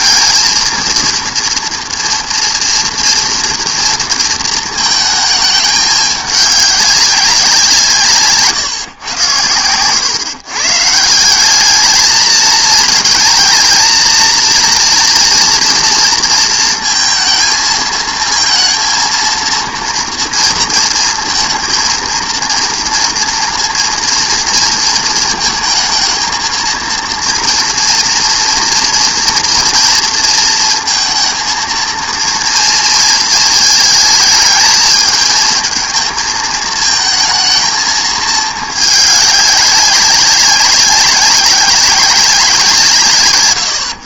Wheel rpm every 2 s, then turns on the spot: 230, 230, 230, 200, 140, 140, 230, 230, 230, 230, 230, 230, 230, 230, 230, 230, 230, 220, 220, 220, 190, 180.
none